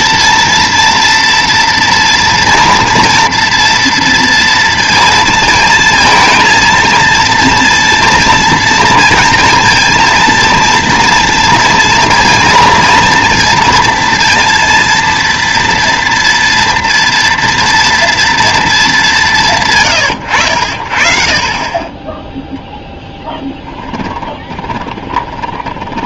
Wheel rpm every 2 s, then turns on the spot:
230, 230, 230, 230, 230, 230, 230, 230, 230, 220, 60, 0, 20.
24-26